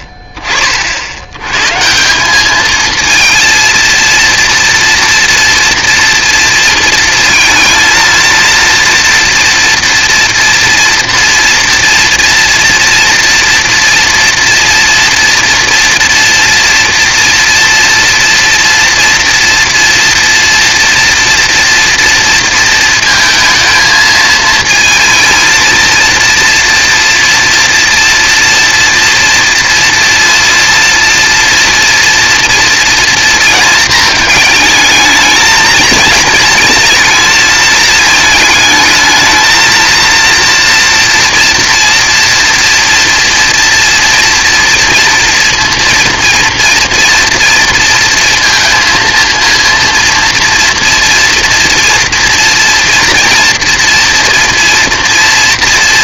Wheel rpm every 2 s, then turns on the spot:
30, 210, 230, 230, 230, 240, 240, 230, 230, 240, 240, 230, 220, 230, 230, 230, 230, 220, 220, 220, 230, 230, 230, 230, 230, 240, 230, 230.
none